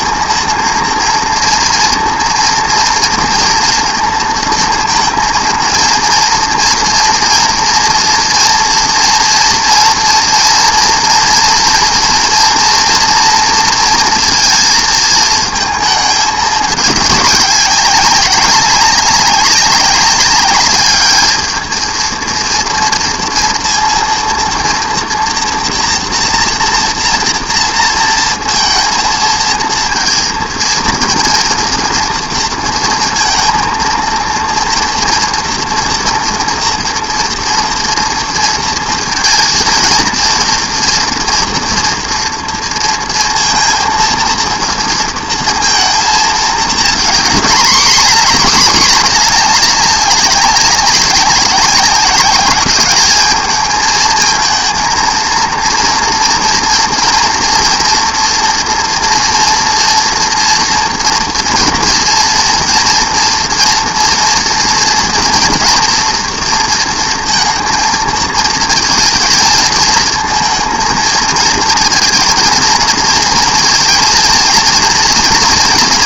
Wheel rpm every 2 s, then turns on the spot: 230, 230, 230, 230, 230, 230, 230, 230, 210, 190, 210, 230, 230, 230, 230, 230, 230, 230, 230, 230, 230, 230, 230, 220, 230, 190, 200, 220, 230, 240, 240, 230, 230, 230, 220, 230, 230, 230.
none